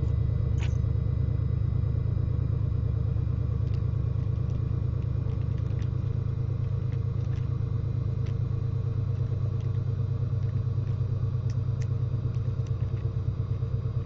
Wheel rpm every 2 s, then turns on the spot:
0, 0, 0, 0, 0, 0, 0.
none